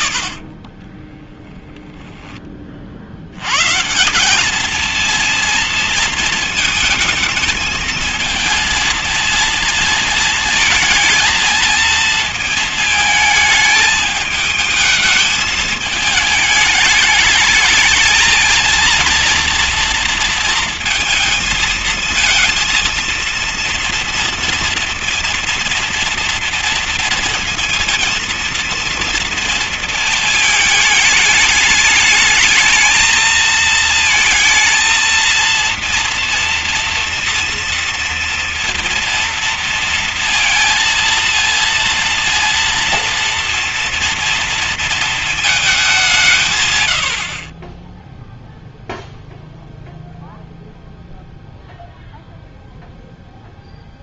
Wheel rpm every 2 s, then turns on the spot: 10, 30, 220, 220, 220, 220, 220, 210, 220, 230, 220, 220, 230, 230, 230, 220, 220, 230, 230, 230, 230, 230, 220, 120, 0, 0, 0.
0-2